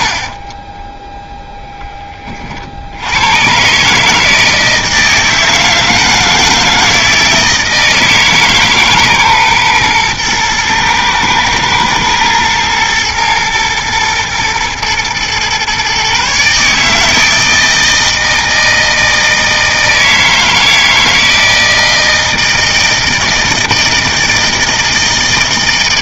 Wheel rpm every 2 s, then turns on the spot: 10, 70, 160, 160, 150, 110, 120, 120, 150, 160, 160, 160, 160.
0-2